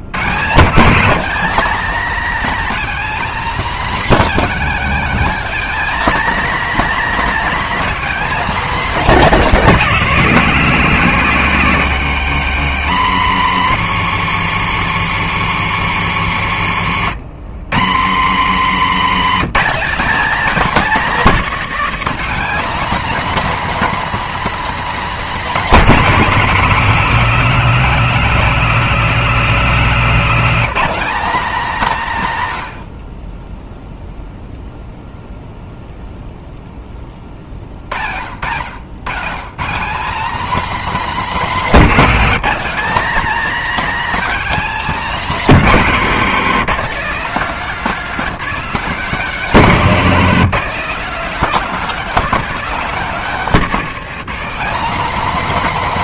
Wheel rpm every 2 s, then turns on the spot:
140, 260, 260, 270, 240, 180, 120, 140, 110, 130, 240, 240, 250, 230, 240, 240, 110, 0, 10, 100, 250, 230, 270, 220, 220, 220, 240, 250.
18-20